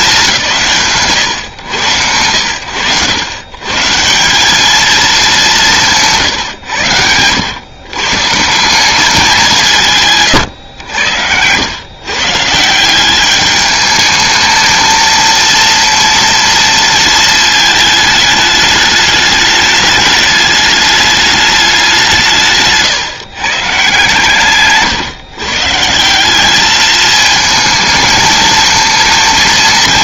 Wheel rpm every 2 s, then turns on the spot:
140, 90, 180, 110, 180, 110, 160, 220, 230, 210, 210, 150, 140, 200, 220.
none